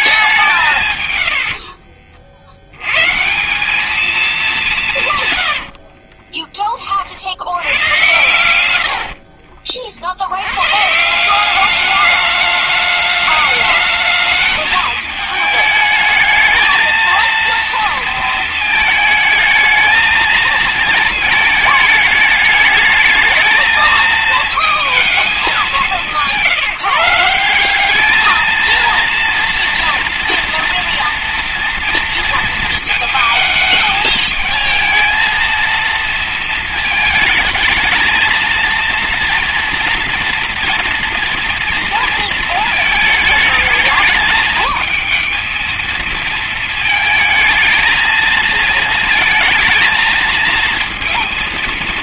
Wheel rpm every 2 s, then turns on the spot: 180, 60, 200, 30, 90, 100, 210, 220, 220, 220, 230, 220, 230, 170, 220, 230, 230, 220, 220, 230, 240, 220, 220, 230, 230, 220.
8-10